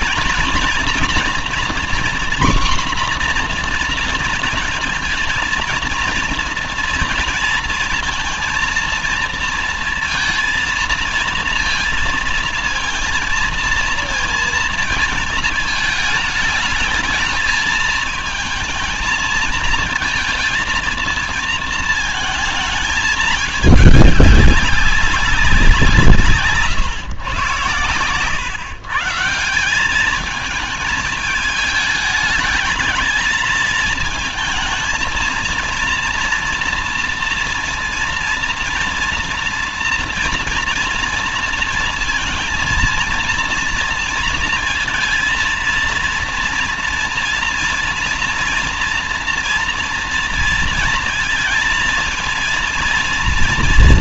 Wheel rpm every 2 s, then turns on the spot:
220, 250, 230, 230, 230, 230, 230, 230, 220, 220, 230, 220, 200, 130, 130, 220, 220, 220, 230, 230, 230, 230, 220, 230, 230, 230, 230.
none